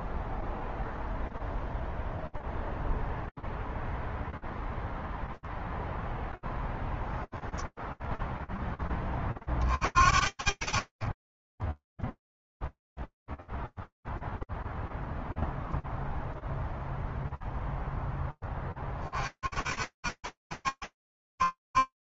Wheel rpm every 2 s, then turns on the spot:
0, 0, 0, 0, 10, 50, 0, 0, 0, 20, 70.
none